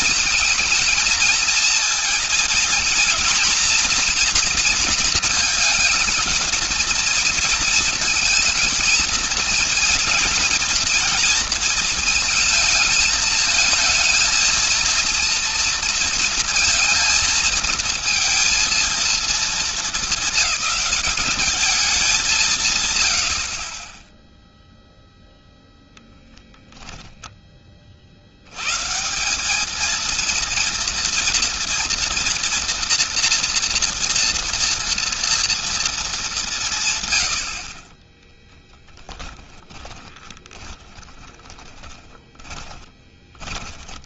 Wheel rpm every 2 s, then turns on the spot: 220, 240, 240, 230, 230, 230, 220, 220, 230, 230, 200, 110, 0, 0, 140, 230, 230, 230, 150, 20, 20, 20.
38-44